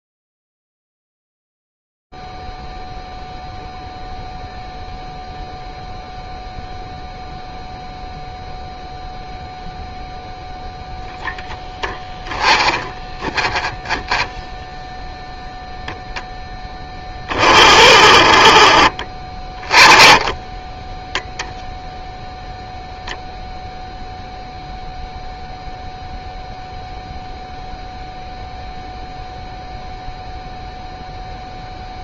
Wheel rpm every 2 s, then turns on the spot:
0, 0, 0, 0, 0, 0, 20, 0, 30, 30, 10, 0, 0, 0, 0, 0.
12-14